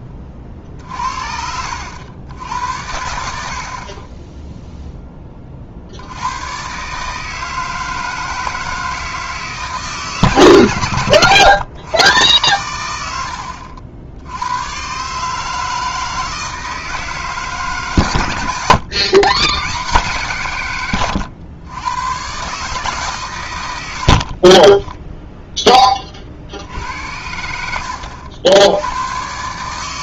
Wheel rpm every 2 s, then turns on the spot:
30, 80, 0, 120, 160, 120, 100, 120, 160, 100, 140, 140, 20, 70, 90.
18-20 24-26